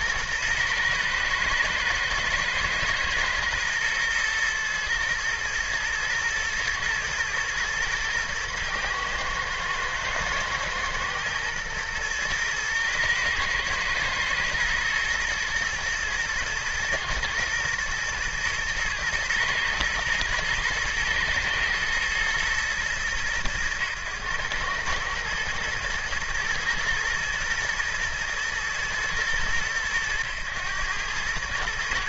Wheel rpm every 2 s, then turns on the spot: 110, 120, 110, 110, 110, 110, 110, 120, 120, 110, 110, 110, 110, 120, 110, 100.
none